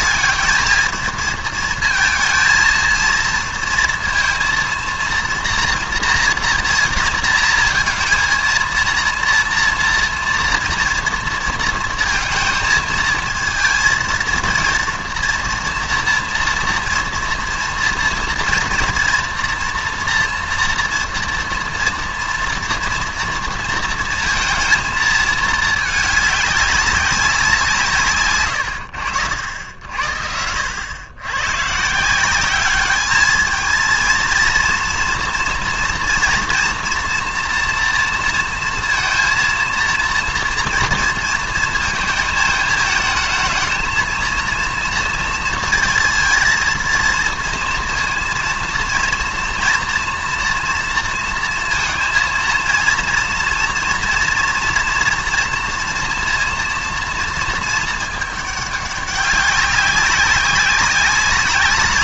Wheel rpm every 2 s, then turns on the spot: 220, 220, 230, 230, 230, 230, 220, 230, 230, 240, 230, 240, 230, 210, 110, 90, 200, 230, 230, 230, 230, 220, 230, 230, 230, 230, 230, 230, 230, 210, 200.
none